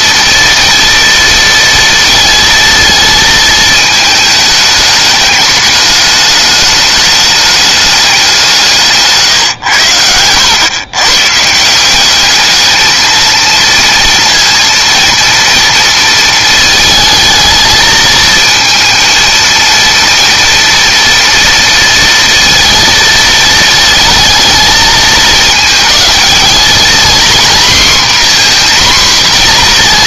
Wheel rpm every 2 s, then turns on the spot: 230, 230, 210, 210, 150, 120, 220, 230, 220, 230, 240, 230, 220, 240, 250.
none